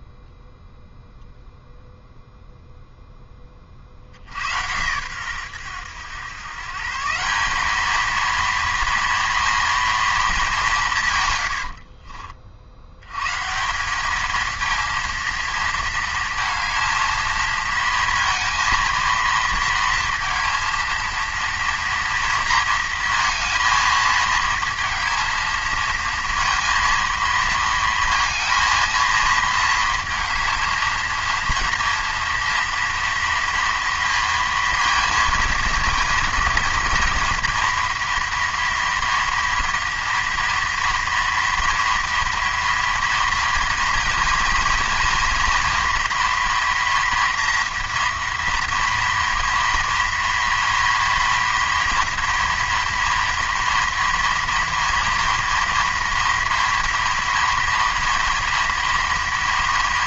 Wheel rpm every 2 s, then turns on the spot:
0, 0, 100, 130, 230, 200, 60, 220, 220, 220, 230, 230, 220, 230, 220, 220, 230, 230, 230, 230, 230, 230, 230, 230, 230, 230, 230, 230, 230, 240.
none